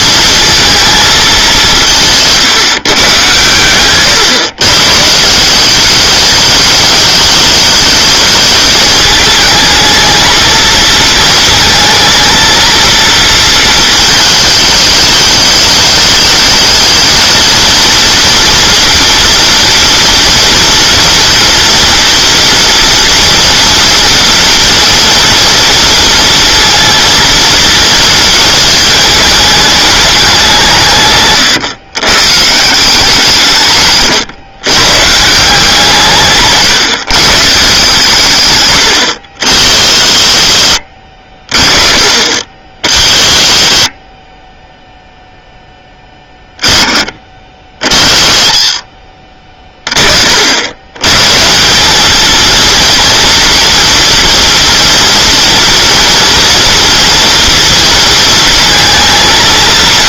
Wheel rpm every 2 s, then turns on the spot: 230, 150, 140, 210, 210, 230, 230, 220, 220, 230, 230, 230, 240, 230, 220, 160, 160, 120, 140, 130, 60, 40, 10, 20, 40, 90, 230, 230, 230, 230.
40-42 48-50